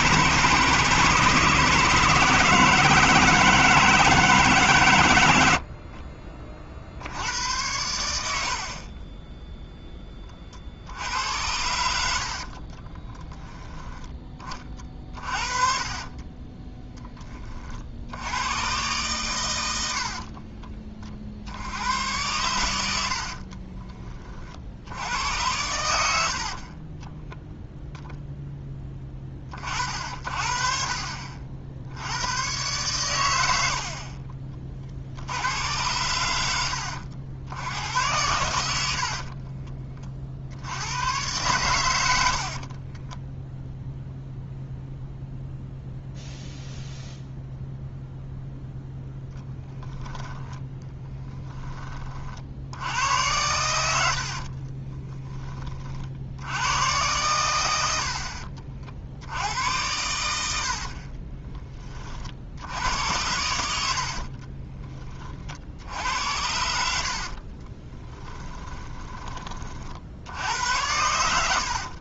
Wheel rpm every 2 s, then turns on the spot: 160, 160, 130, 60, 30, 70, 30, 40, 20, 120, 40, 80, 70, 30, 10, 50, 120, 50, 70, 60, 110, 20, 0, 0, 0, 10, 80, 30, 100, 60, 60, 80, 20, 70, 20, 80.
12-18 26-28 42-44 50-52 54-56 60-62 68-70